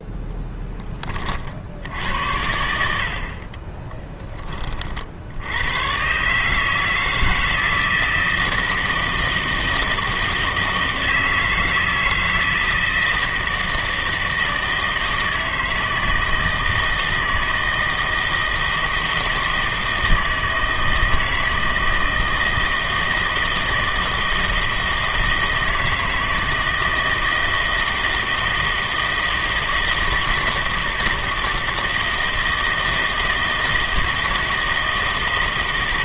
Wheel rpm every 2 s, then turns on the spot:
10, 80, 30, 150, 160, 160, 160, 160, 160, 160, 160, 160, 160, 160, 160, 160, 160, 160.
none